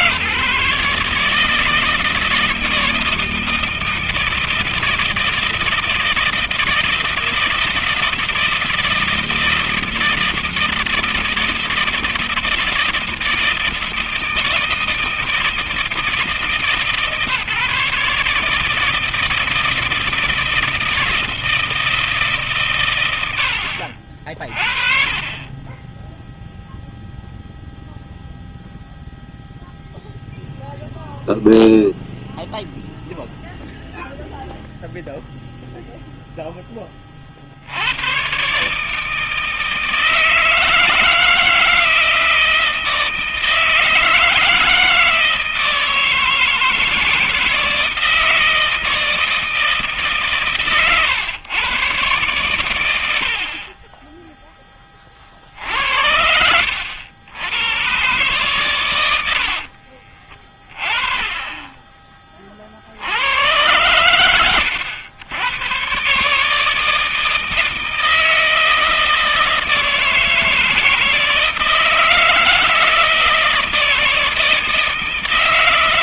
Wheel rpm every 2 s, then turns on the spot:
150, 160, 160, 160, 160, 160, 160, 160, 150, 150, 160, 130, 50, 0, 0, 0, 0, 0, 10, 140, 160, 160, 160, 160, 160, 140, 110, 20, 70, 130, 30, 30, 120, 150, 160, 160, 160, 160.
none